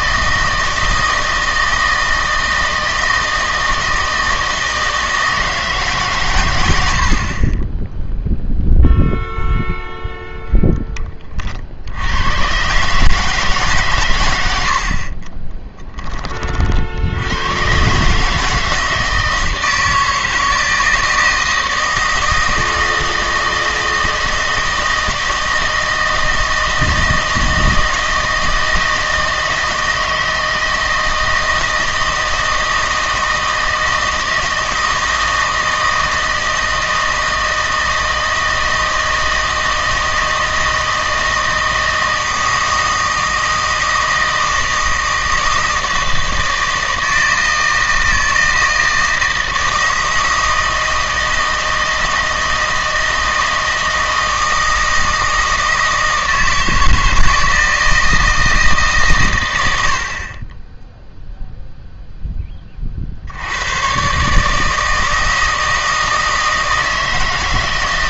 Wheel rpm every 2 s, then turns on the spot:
160, 160, 160, 90, 0, 20, 140, 60, 60, 160, 160, 160, 160, 160, 160, 160, 160, 160, 160, 160, 160, 160, 160, 160, 160, 160, 160, 160, 160, 150, 10, 30, 160, 160.
14-16